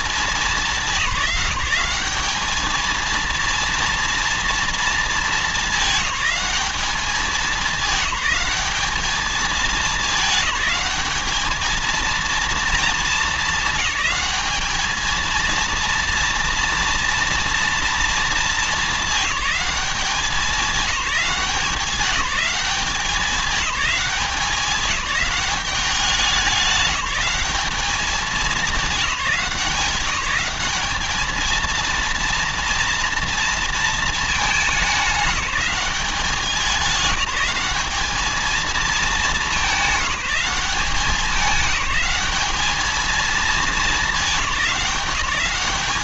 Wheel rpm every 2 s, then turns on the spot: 190, 230, 210, 190, 210, 220, 220, 220, 240, 210, 200, 200, 190, 190, 200, 220, 230, 210, 200, 220, 200, 220, 190.
none